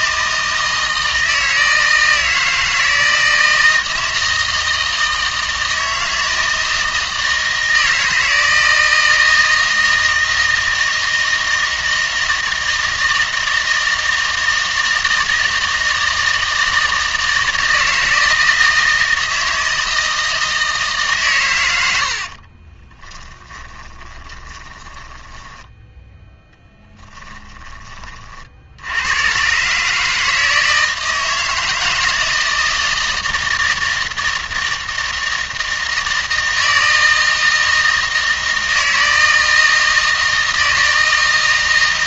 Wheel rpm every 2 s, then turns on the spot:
160, 160, 160, 160, 160, 160, 160, 160, 160, 160, 160, 30, 20, 10, 70, 160, 160, 160, 160, 160, 160.
22-26